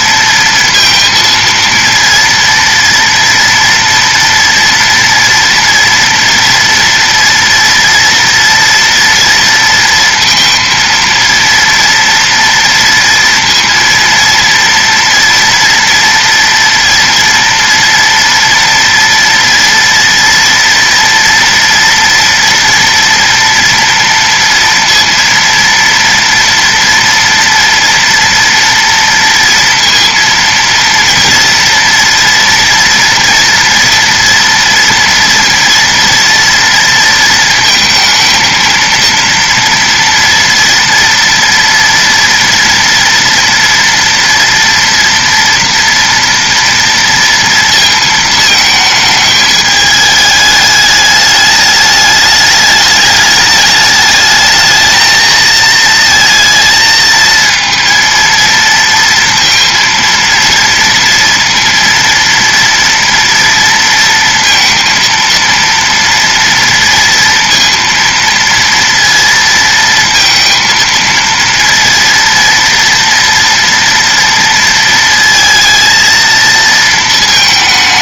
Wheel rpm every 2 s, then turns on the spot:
230, 230, 240, 230, 230, 230, 230, 230, 230, 240, 230, 230, 230, 230, 230, 230, 240, 230, 230, 230, 230, 230, 230, 230, 220, 210, 210, 220, 220, 230, 230, 230, 230, 230, 230, 230, 240, 230, 230.
none